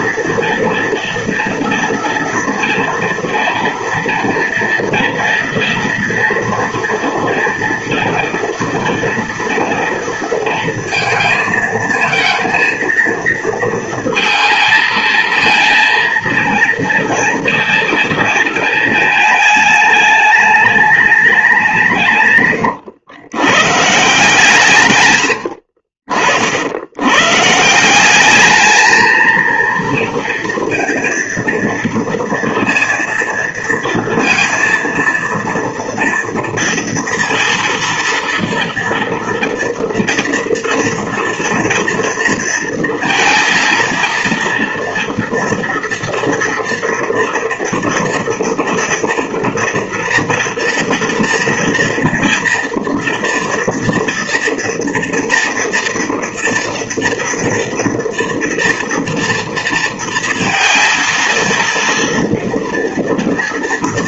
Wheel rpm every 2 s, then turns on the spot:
230, 230, 230, 230, 230, 230, 230, 230, 230, 220, 210, 120, 140, 80, 210, 230, 230, 230, 230, 230, 230, 230, 230, 230, 230, 230, 230, 230, 240, 240, 230, 230.
none